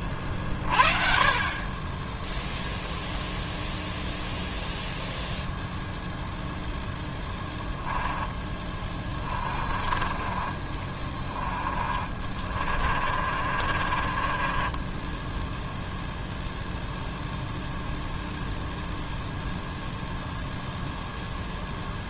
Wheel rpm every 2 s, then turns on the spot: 30, 0, 0, 0, 10, 30, 40, 20, 0, 0, 0.
8-16